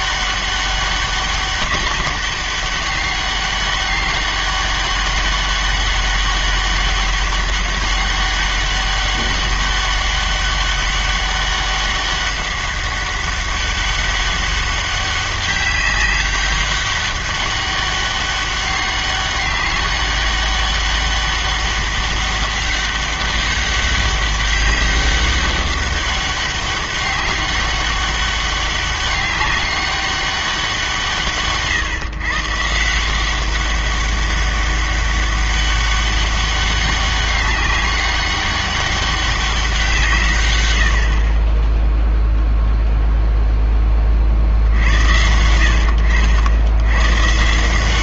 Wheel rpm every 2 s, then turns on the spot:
200, 200, 200, 200, 200, 200, 200, 200, 200, 200, 200, 200, 200, 200, 190, 180, 150, 200, 200, 200, 100, 0, 70, 90.
none